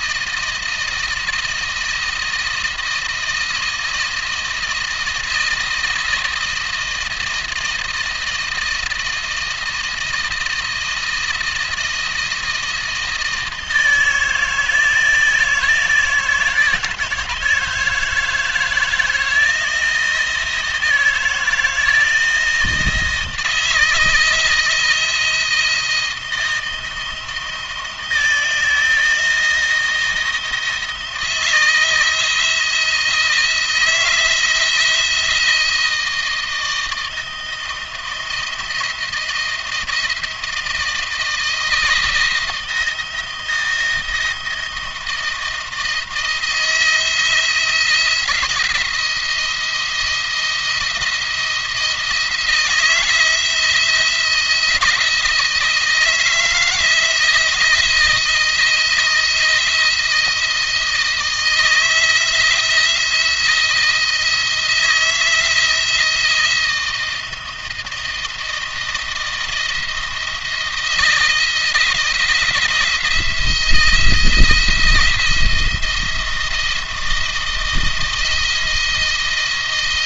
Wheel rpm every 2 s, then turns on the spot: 170, 160, 160, 160, 170, 160, 160, 160, 160, 160, 160, 160, 160, 170, 160, 160, 170, 170, 160, 160, 160, 160, 160, 160, 170, 170, 170, 170, 160, 170, 160, 160, 160, 160, 160, 170, 170, 160, 170, 170.
none